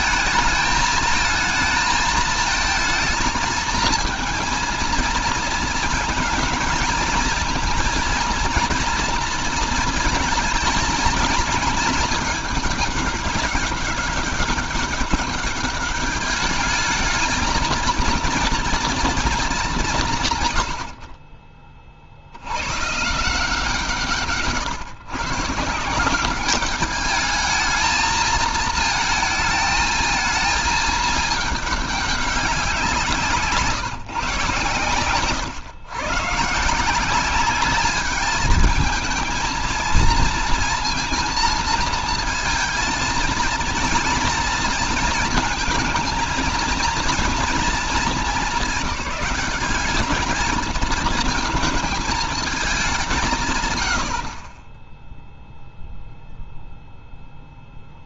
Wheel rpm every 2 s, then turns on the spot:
220, 220, 230, 230, 240, 220, 210, 200, 210, 230, 90, 130, 120, 210, 230, 220, 180, 130, 160, 220, 230, 220, 220, 230, 210, 220, 200, 20, 0.
none